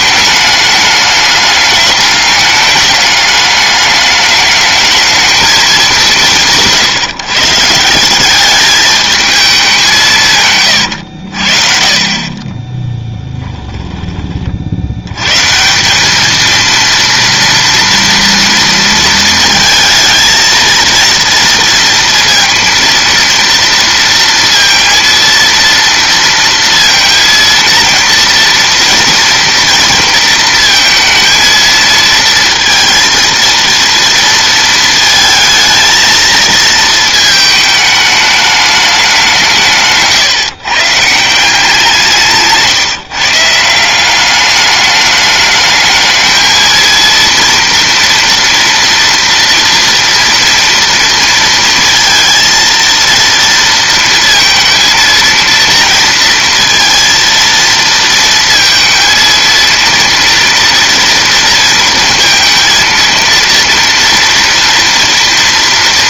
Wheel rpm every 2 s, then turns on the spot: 210, 210, 210, 150, 210, 90, 10, 90, 230, 230, 230, 230, 230, 230, 230, 230, 230, 230, 230, 200, 150, 150, 210, 230, 240, 230, 230, 230, 230, 220, 230, 230, 230.
12-14